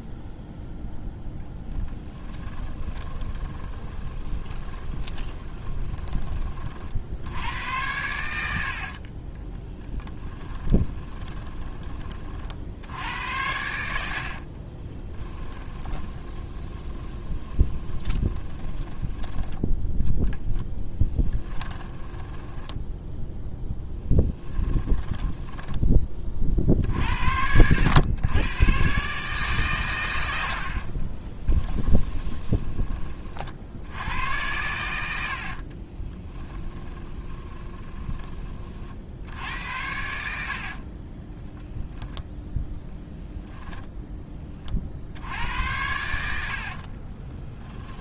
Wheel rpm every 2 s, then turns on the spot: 0, 10, 20, 60, 50, 10, 70, 30, 30, 10, 10, 10, 10, 50, 130, 40, 20, 100, 20, 50, 40, 0, 40, 50.
2-6 10-12 14-26 30-32 36-38 40-42 46-48